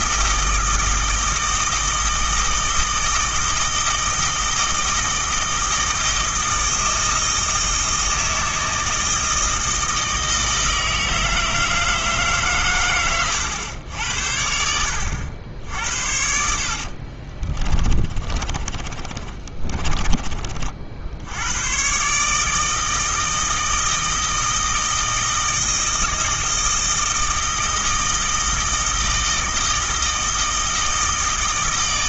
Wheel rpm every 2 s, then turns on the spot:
160, 160, 160, 160, 160, 160, 120, 80, 60, 30, 50, 160, 160, 160, 160, 160.
16-20